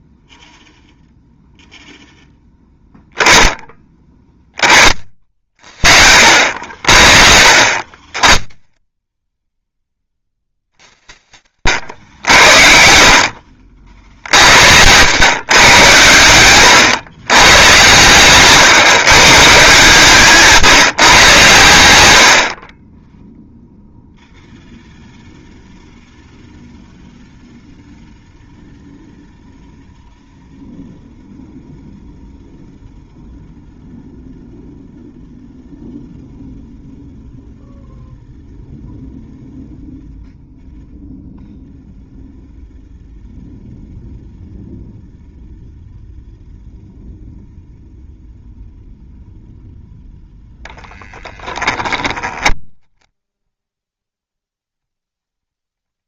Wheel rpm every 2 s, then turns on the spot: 0, 10, 30, 80, 10, 50, 60, 70, 110, 140, 160, 30, 0, 0, 0, 0, 0, 0, 0, 0, 0, 0, 0, 0, 0, 10, 10, 10.
52-54